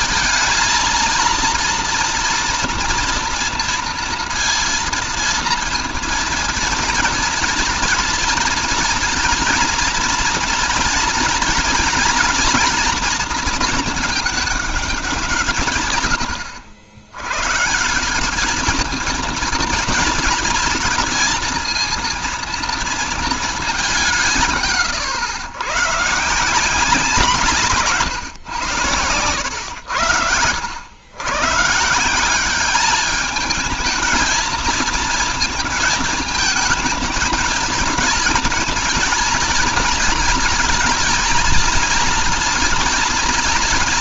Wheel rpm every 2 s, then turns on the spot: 230, 230, 230, 230, 240, 240, 240, 210, 90, 220, 230, 230, 130, 170, 110, 90, 200, 220, 220, 230, 230, 230.
none